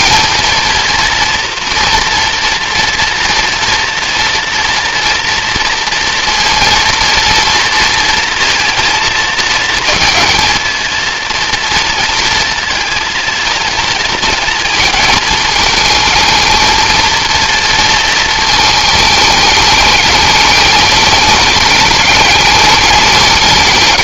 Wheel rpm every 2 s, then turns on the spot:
230, 230, 230, 230, 230, 230, 230, 230, 230, 220, 210, 210.
none